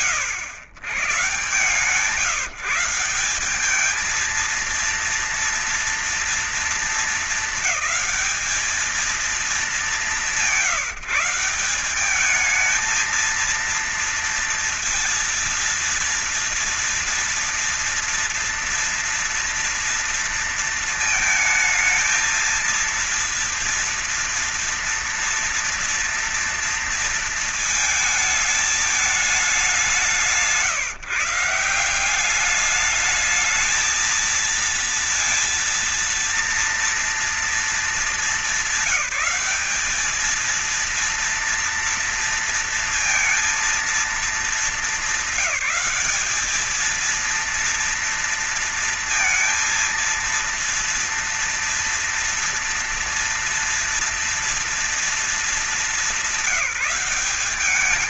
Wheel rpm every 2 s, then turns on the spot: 110, 160, 230, 230, 220, 170, 210, 230, 240, 230, 230, 230, 230, 230, 210, 150, 200, 230, 230, 200, 220, 230, 210, 210, 230, 230, 230, 230, 190.
none